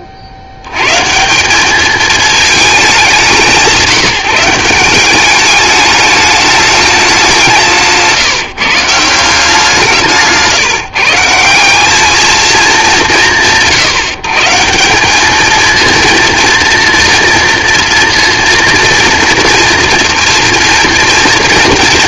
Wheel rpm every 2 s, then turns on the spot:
100, 220, 180, 210, 150, 140, 220, 170, 230, 230, 240.
none